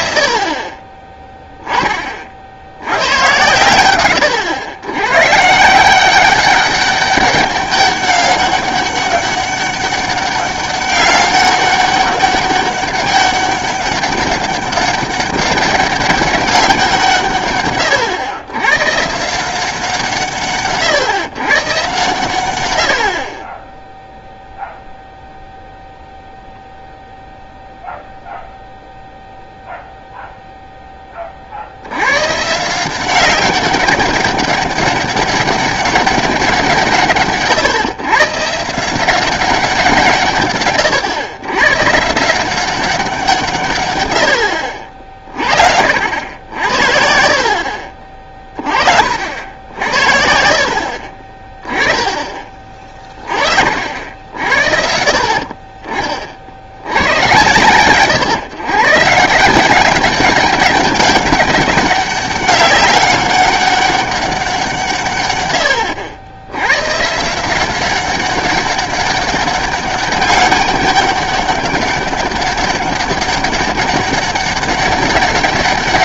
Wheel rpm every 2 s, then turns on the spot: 40, 60, 110, 190, 200, 200, 200, 200, 180, 110, 140, 110, 0, 0, 0, 0, 150, 200, 170, 150, 130, 180, 70, 70, 30, 60, 30, 60, 80, 130, 200, 200, 170, 100, 190, 200, 200, 200.
none